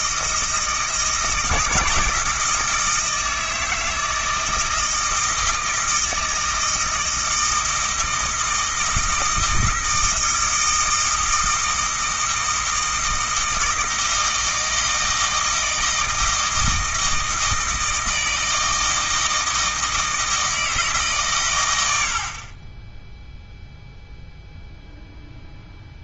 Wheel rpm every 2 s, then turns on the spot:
160, 160, 160, 160, 160, 160, 160, 160, 160, 160, 150, 10, 0.
none